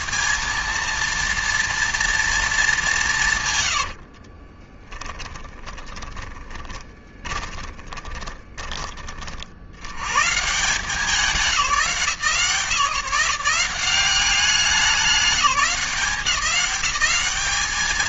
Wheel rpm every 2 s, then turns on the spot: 230, 180, 20, 20, 40, 170, 150, 200, 200.
4-8